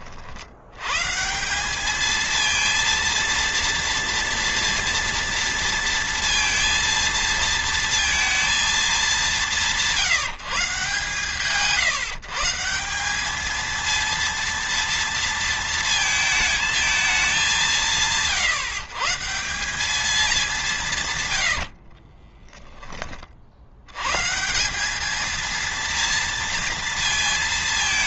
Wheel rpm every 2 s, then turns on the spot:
70, 230, 230, 230, 220, 140, 170, 230, 220, 140, 210, 20, 160, 230.
22-24